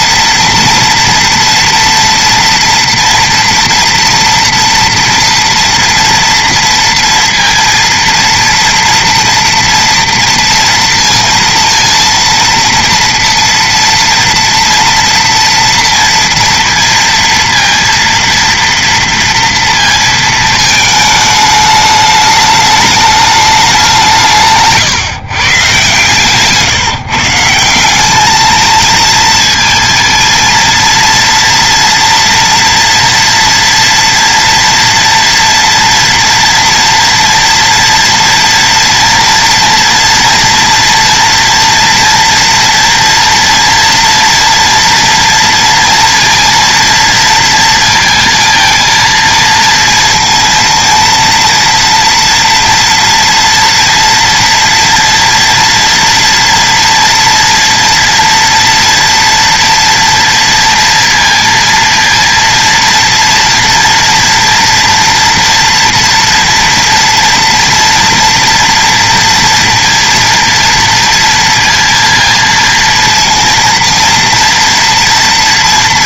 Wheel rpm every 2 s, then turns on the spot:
230, 240, 240, 230, 230, 230, 230, 230, 230, 230, 220, 210, 140, 150, 220, 230, 230, 230, 230, 230, 230, 230, 230, 230, 230, 230, 230, 230, 230, 230, 230, 230, 230, 230, 230, 230, 230, 230.
none